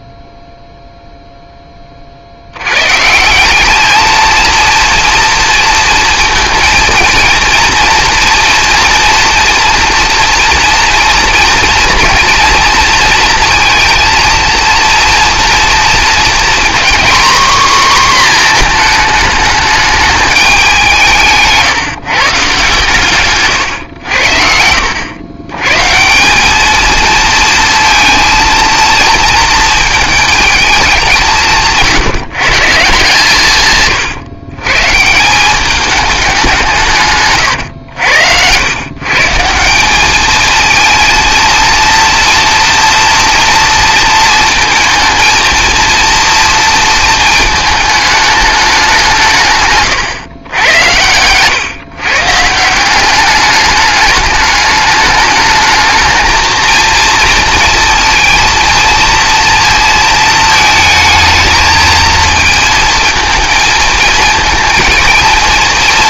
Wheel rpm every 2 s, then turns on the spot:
0, 120, 230, 230, 230, 230, 230, 230, 250, 230, 180, 140, 80, 220, 230, 210, 160, 130, 170, 100, 220, 230, 220, 230, 200, 110, 170, 210, 230, 230, 220, 230, 230.
none